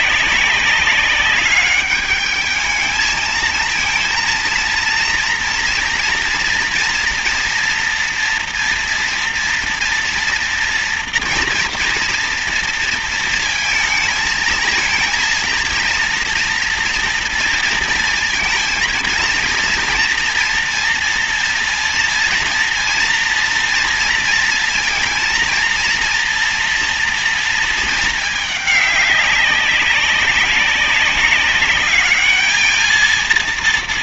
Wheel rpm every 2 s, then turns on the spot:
190, 210, 230, 240, 240, 230, 230, 220, 230, 230, 230, 230, 230, 230, 210, 200, 220.
none